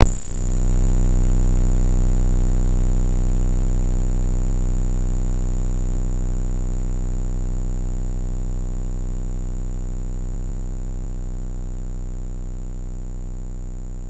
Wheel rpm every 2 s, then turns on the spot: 0, 0, 0, 0, 0, 0, 0.
none